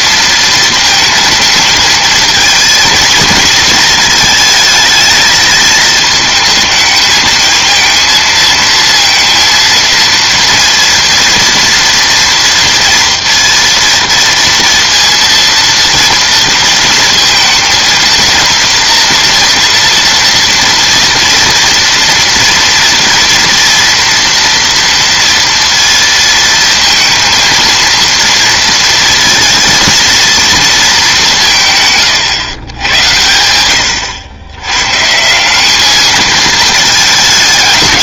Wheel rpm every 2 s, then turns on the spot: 230, 220, 220, 220, 220, 230, 230, 230, 230, 230, 230, 230, 230, 230, 230, 230, 140, 110, 220.
none